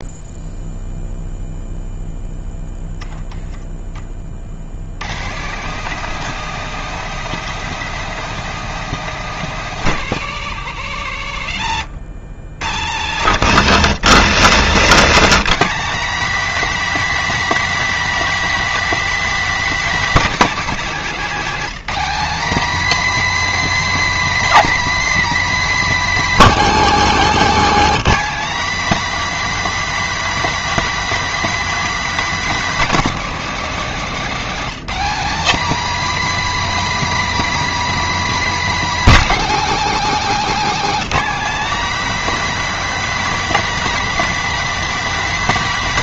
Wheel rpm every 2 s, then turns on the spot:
0, 10, 130, 190, 170, 60, 90, 170, 290, 280, 230, 280, 290, 250, 280, 290, 250, 240, 290, 270, 260, 290, 280.
none